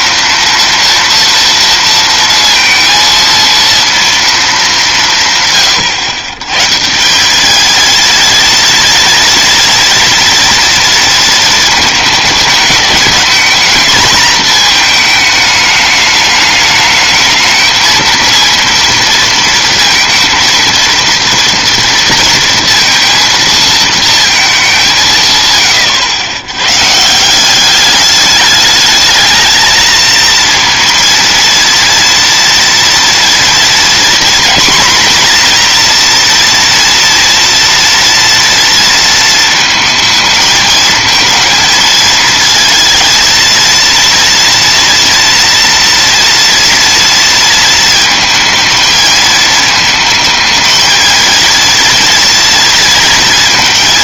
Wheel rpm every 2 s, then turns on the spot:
230, 230, 130, 220, 240, 220, 220, 210, 220, 230, 230, 230, 110, 190, 220, 230, 240, 240, 230, 220, 220, 230, 230, 230, 220, 230, 230.
none